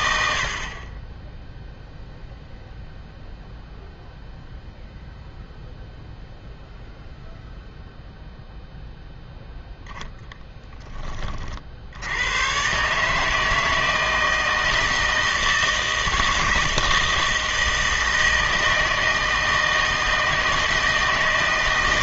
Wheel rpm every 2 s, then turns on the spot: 40, 0, 0, 0, 0, 10, 130, 160, 160, 160, 160.
none